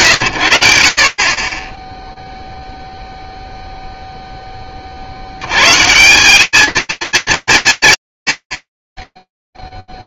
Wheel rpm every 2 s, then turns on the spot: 70, 0, 50, 220, 50.
none